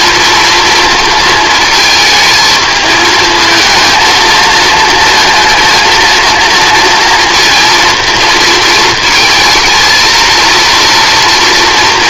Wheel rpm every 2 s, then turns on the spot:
230, 220, 230, 230, 220, 230.
none